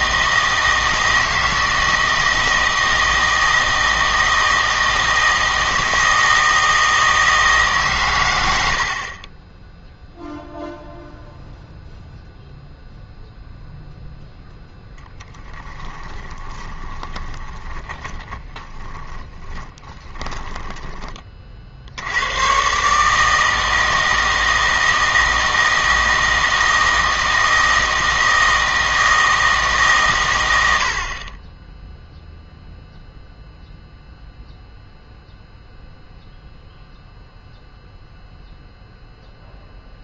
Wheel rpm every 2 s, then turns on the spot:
160, 160, 160, 160, 70, 0, 0, 0, 20, 20, 20, 120, 160, 160, 160, 90, 0, 0, 0, 0.
8-10 16-22